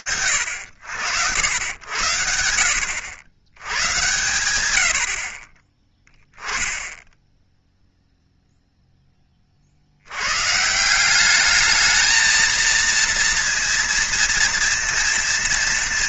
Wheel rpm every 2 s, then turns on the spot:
80, 90, 20, 0, 30, 200, 230, 230.
none